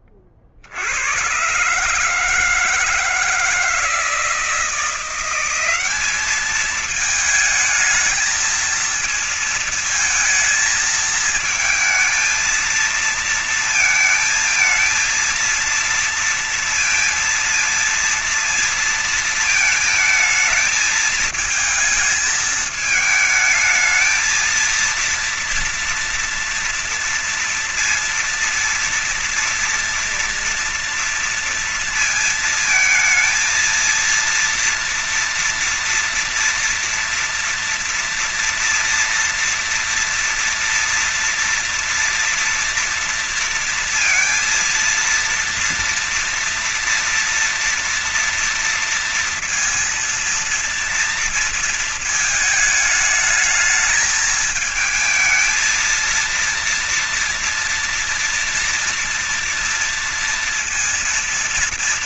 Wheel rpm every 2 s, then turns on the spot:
40, 150, 160, 200, 220, 220, 220, 220, 230, 230, 220, 220, 220, 230, 230, 230, 230, 230, 240, 230, 230, 230, 230, 230, 230, 230, 220, 220, 230, 230, 230.
none